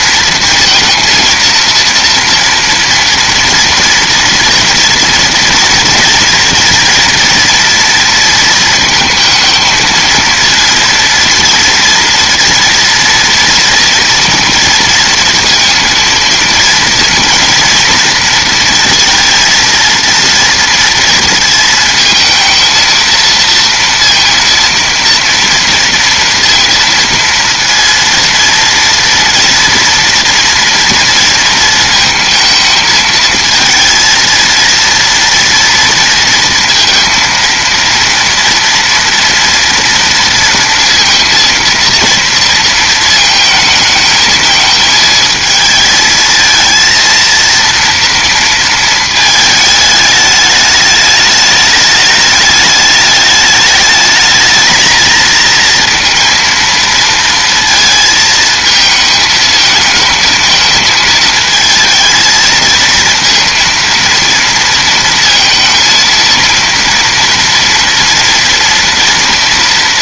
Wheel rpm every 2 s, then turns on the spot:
230, 230, 230, 230, 230, 230, 230, 230, 230, 230, 230, 230, 230, 230, 230, 230, 220, 230, 230, 230, 230, 230, 220, 220, 230, 210, 210, 220, 230, 220, 220, 230, 230, 230, 230.
none